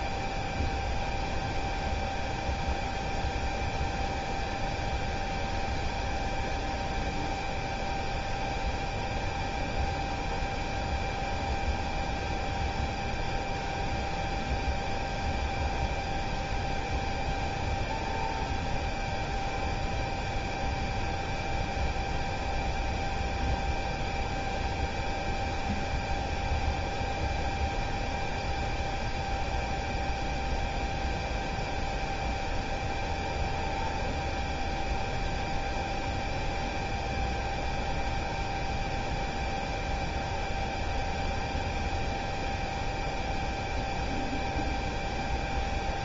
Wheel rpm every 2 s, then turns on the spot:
0, 0, 0, 0, 0, 0, 0, 0, 0, 0, 0, 0, 0, 0, 0, 0, 0, 0, 0, 0, 0, 0, 0.
none